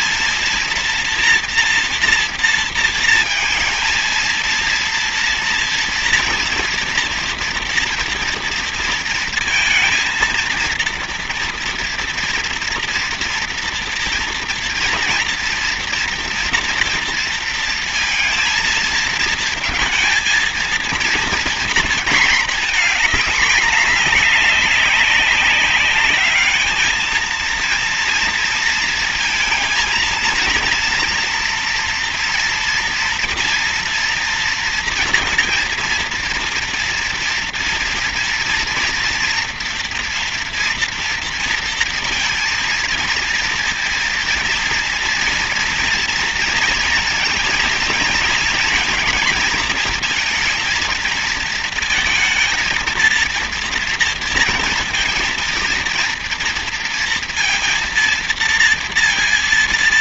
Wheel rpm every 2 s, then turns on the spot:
230, 230, 230, 230, 230, 230, 230, 230, 230, 220, 230, 220, 200, 220, 230, 230, 230, 230, 230, 230, 230, 230, 230, 230, 230, 230, 220, 230, 230, 230.
none